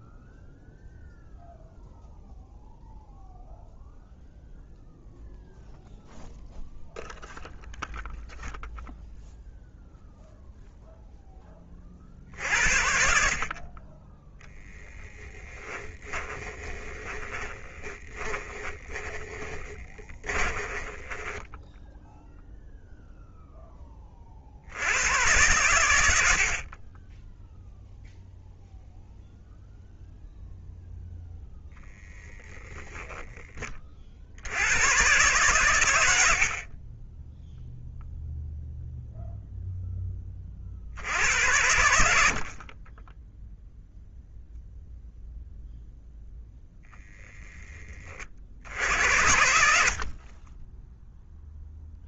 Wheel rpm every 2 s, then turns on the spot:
0, 0, 0, 0, 0, 0, 60, 10, 20, 20, 20, 0, 100, 20, 0, 0, 10, 120, 20, 0, 60, 20, 0, 0, 80, 0.
14-22